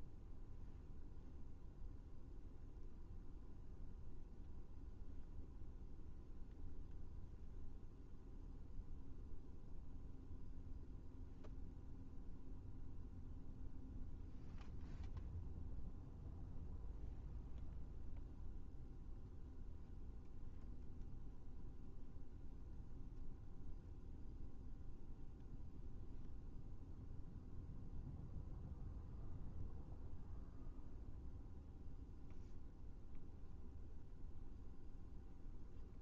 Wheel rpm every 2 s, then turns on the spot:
0, 0, 0, 0, 0, 0, 0, 0, 0, 0, 0, 0, 0, 0, 0, 0, 0, 0.
none